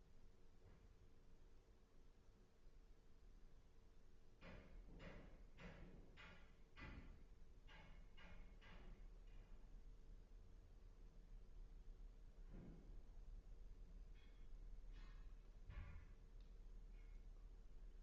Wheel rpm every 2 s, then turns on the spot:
0, 0, 0, 0, 0, 0, 0, 0, 0.
none